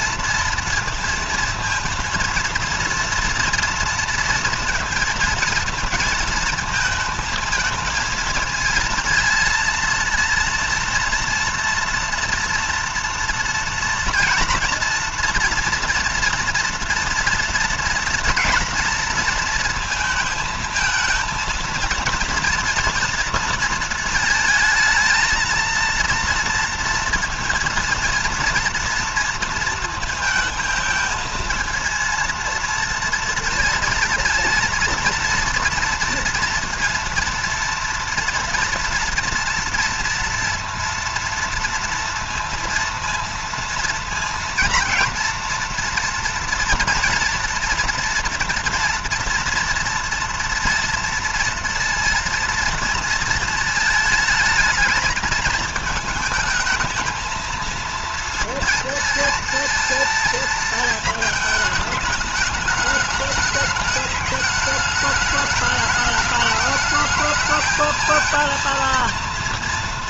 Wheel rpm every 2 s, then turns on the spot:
230, 230, 230, 230, 230, 230, 230, 230, 230, 230, 220, 230, 220, 230, 230, 220, 230, 230, 230, 240, 230, 230, 240, 230, 230, 230, 230, 220, 220, 230, 220, 210, 210, 210, 230.
none